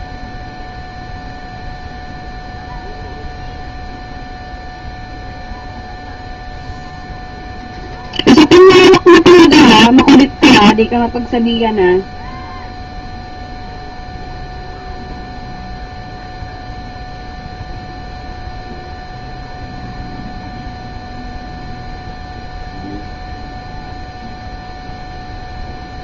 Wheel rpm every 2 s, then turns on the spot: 0, 0, 0, 0, 0, 0, 0, 0, 0, 0, 0, 0, 0.
none